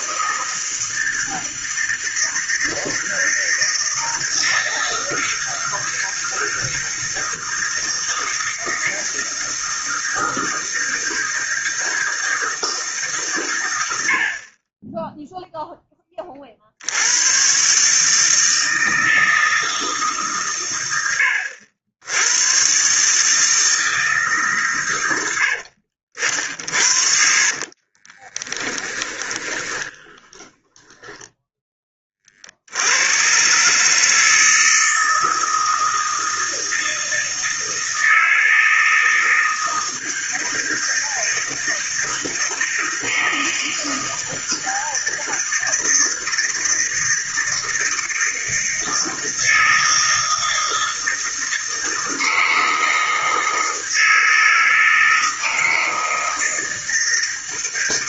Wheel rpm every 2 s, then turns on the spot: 160, 160, 160, 160, 160, 160, 160, 40, 40, 160, 130, 110, 150, 60, 20, 20, 50, 160, 160, 160, 160, 160, 160, 160, 160, 160, 160, 160, 160.
26-32